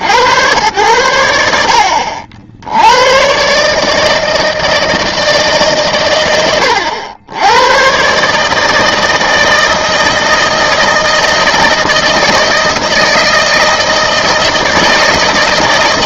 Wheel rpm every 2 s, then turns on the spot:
80, 60, 160, 110, 140, 160, 160, 160.
none